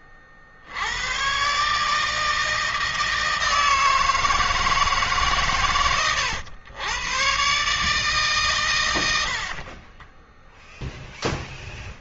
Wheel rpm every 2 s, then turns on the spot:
60, 160, 160, 110, 140, 10.
none